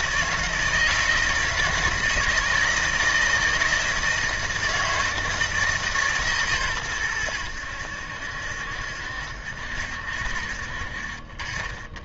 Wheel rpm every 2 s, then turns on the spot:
160, 160, 160, 130, 70, 60.
none